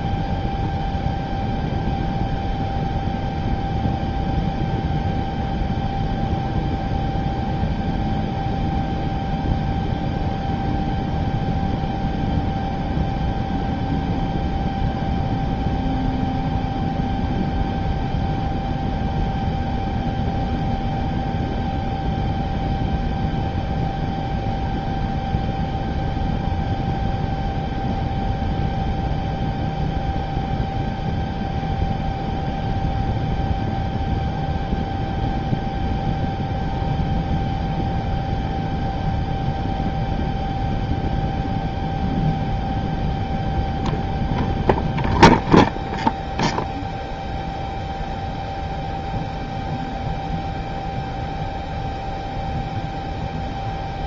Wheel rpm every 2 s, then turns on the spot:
0, 0, 0, 0, 0, 0, 0, 0, 0, 0, 0, 0, 0, 0, 0, 0, 0, 0, 0, 0, 0, 0, 0, 0, 0, 0, 0.
none